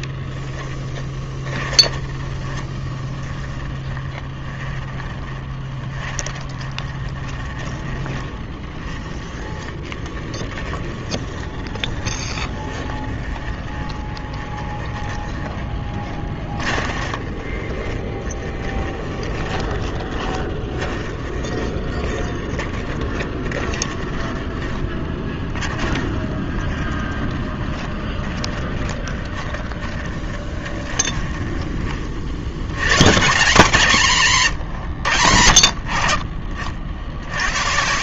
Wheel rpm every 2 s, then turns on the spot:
10, 20, 20, 20, 20, 20, 20, 20, 20, 20, 30, 30, 20, 20, 20, 20, 100, 100, 60.
0-32 34-36